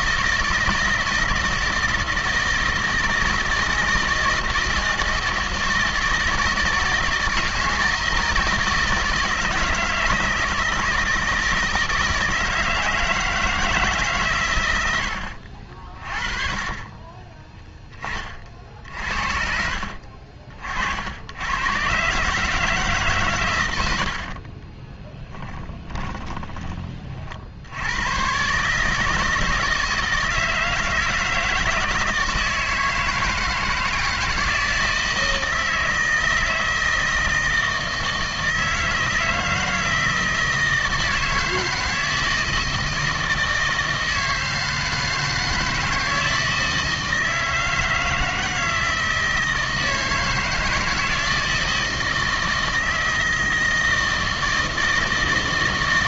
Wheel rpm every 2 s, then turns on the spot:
160, 160, 160, 160, 160, 160, 160, 110, 30, 50, 60, 150, 30, 20, 140, 160, 160, 160, 160, 160, 160, 160, 160, 160, 160, 160, 160, 160.
24-26